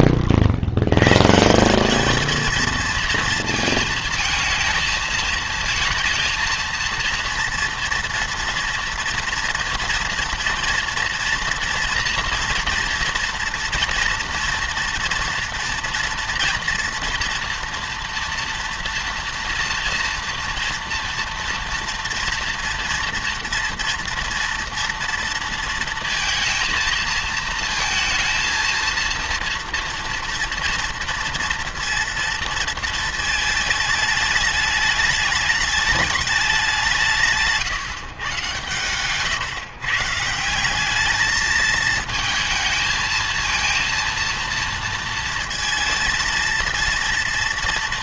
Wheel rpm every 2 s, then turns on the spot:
80, 220, 220, 230, 230, 230, 230, 240, 240, 240, 230, 230, 230, 230, 230, 230, 230, 210, 190, 130, 190, 220, 230, 230.
none